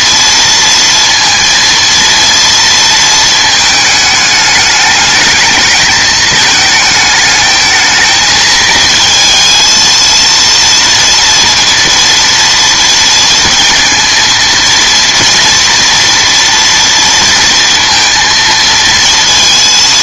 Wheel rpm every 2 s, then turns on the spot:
230, 230, 210, 220, 220, 230, 230, 230, 240, 230.
none